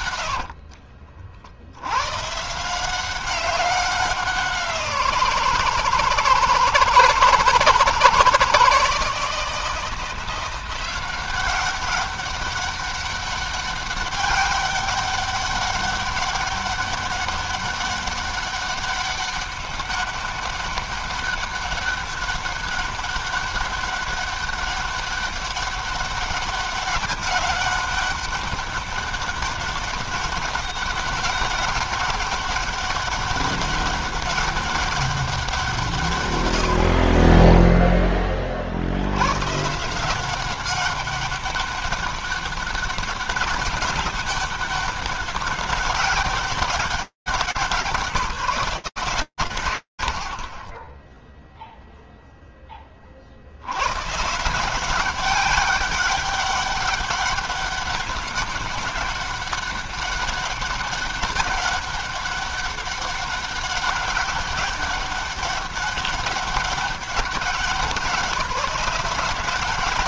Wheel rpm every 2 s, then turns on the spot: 90, 120, 190, 160, 160, 170, 200, 200, 200, 200, 200, 200, 200, 200, 200, 200, 200, 200, 130, 20, 180, 200, 200, 200, 170, 10, 60, 190, 200, 200, 200, 200, 200, 190, 190.
0-2